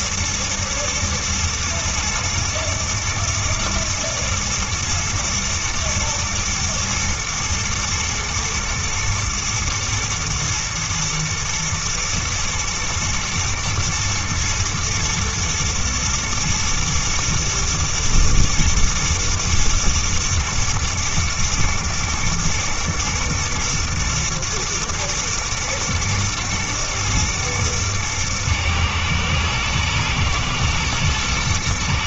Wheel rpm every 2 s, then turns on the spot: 110, 110, 120, 120, 120, 120, 110, 120, 110, 110, 120, 110, 110, 110, 110, 110.
none